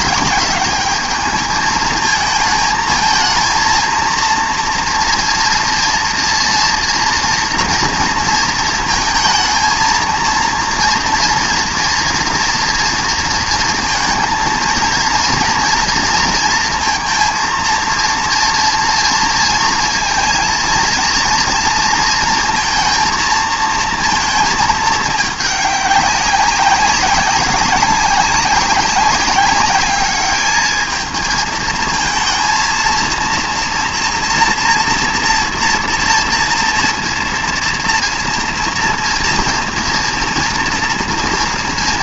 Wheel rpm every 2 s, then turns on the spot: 210, 230, 230, 240, 220, 230, 230, 230, 230, 230, 230, 230, 210, 190, 190, 220, 230, 230, 230, 230, 230.
none